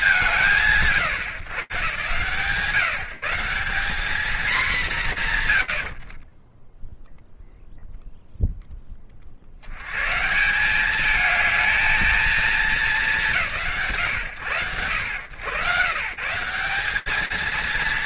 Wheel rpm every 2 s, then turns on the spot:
140, 170, 110, 0, 80, 230, 150, 120, 230.
none